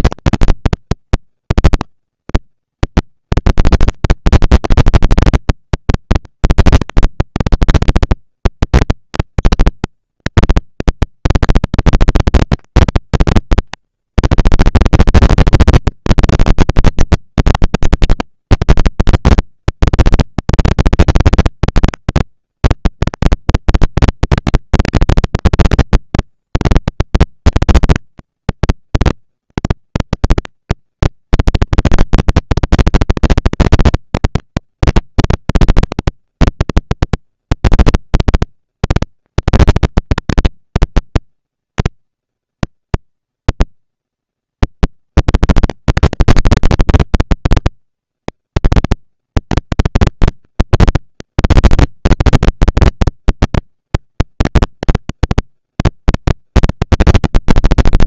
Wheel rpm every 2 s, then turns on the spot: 230, 220, 220, 230, 230, 230, 230, 240, 220, 200, 200, 220, 230, 230, 230, 230, 230, 230, 240, 230, 240, 230, 230, 230, 240, 230, 230, 230, 230.
none